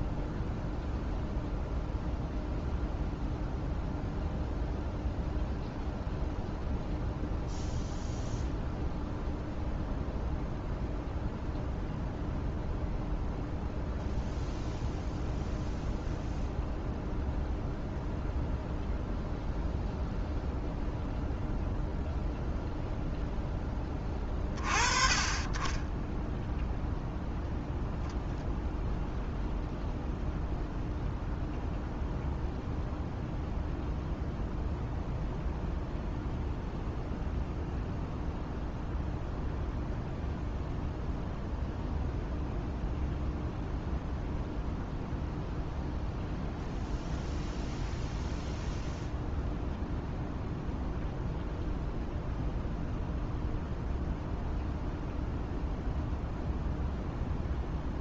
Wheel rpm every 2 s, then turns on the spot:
0, 0, 0, 0, 0, 0, 0, 0, 0, 0, 0, 0, 40, 0, 0, 0, 0, 0, 0, 0, 0, 0, 0, 0, 0, 0, 0, 0, 0.
none